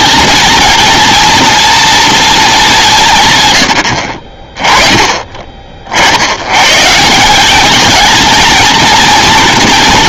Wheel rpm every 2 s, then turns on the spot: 230, 200, 30, 100, 220.
none